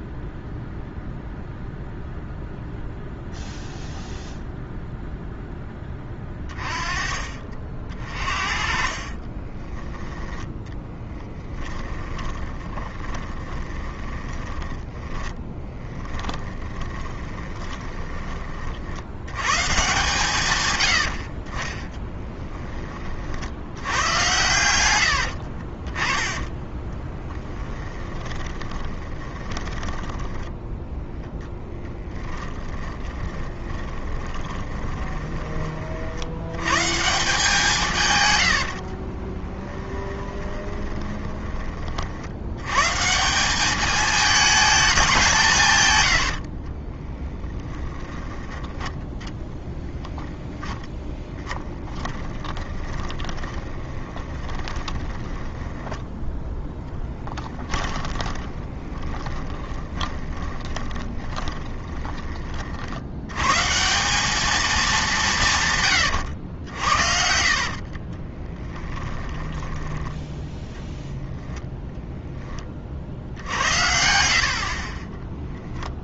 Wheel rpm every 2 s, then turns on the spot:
0, 0, 0, 30, 40, 10, 20, 10, 20, 50, 120, 20, 90, 10, 20, 0, 20, 20, 120, 70, 20, 120, 210, 30, 20, 10, 20, 10, 10, 20, 20, 50, 210, 70, 10, 10, 30, 40.
8-18 24-26 28-30 32-36 38-42 46-48 50-62 68-70